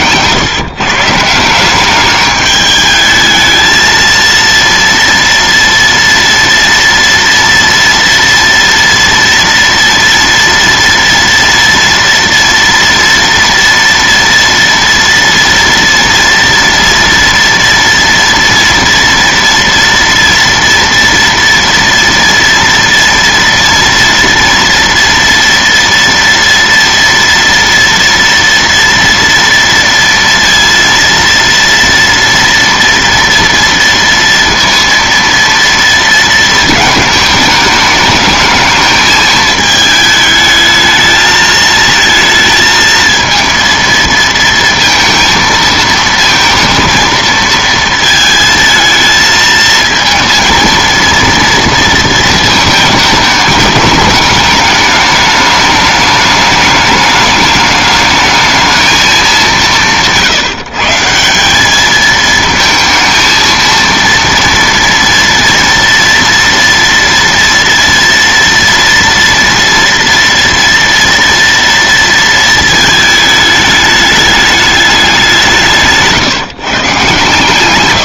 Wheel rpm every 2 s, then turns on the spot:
140, 210, 230, 230, 230, 230, 230, 230, 230, 230, 230, 230, 230, 230, 230, 230, 230, 230, 220, 220, 220, 220, 230, 230, 220, 230, 220, 210, 210, 220, 160, 220, 230, 230, 230, 230, 220, 210, 140.
none